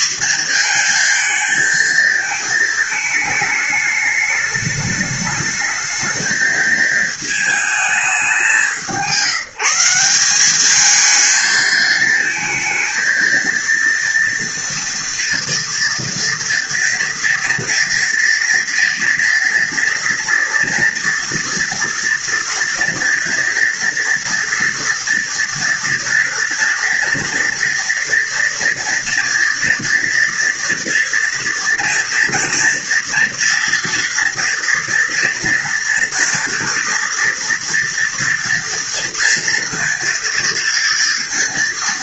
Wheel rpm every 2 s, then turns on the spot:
220, 220, 210, 220, 180, 220, 230, 230, 230, 230, 240, 230, 240, 230, 230, 230, 230, 230, 230, 230, 230.
none